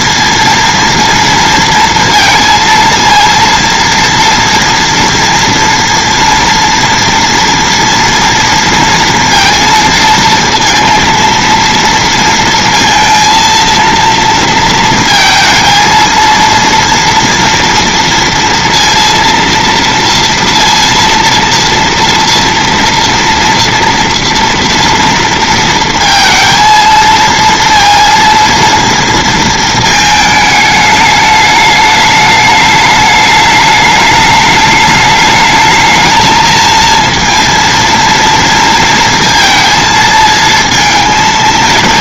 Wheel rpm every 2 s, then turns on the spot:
230, 230, 230, 230, 230, 230, 230, 230, 230, 230, 230, 230, 230, 230, 230, 210, 210, 210, 230, 230, 230.
none